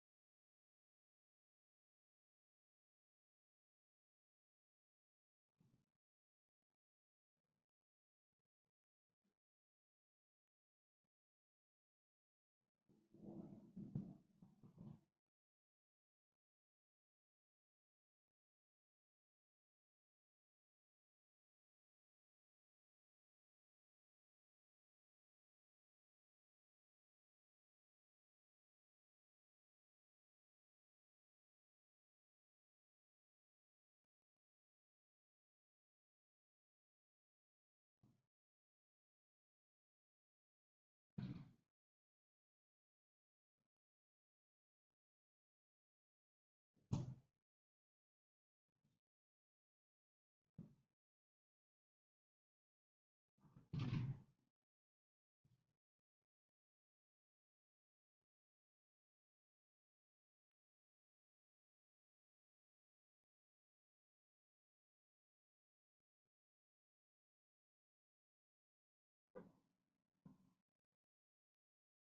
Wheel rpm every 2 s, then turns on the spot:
0, 0, 0, 0, 0, 0, 0, 0, 0, 0, 0, 0, 0, 0, 0, 0, 0, 0, 0, 0, 0, 0, 0, 0, 0, 0, 0, 0, 0, 0, 0, 0, 0, 0, 0, 0.
none